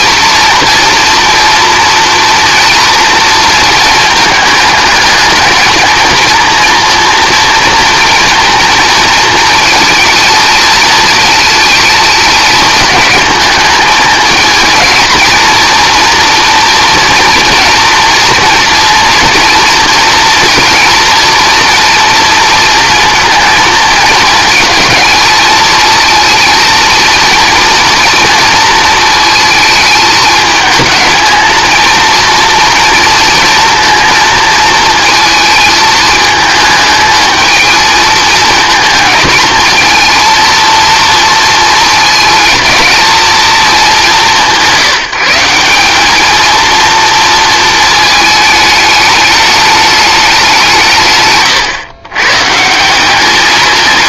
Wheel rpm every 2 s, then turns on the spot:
230, 230, 220, 240, 230, 220, 220, 230, 230, 230, 230, 230, 220, 230, 230, 220, 230, 220, 220, 220, 230, 220, 180, 230, 210, 160, 160.
none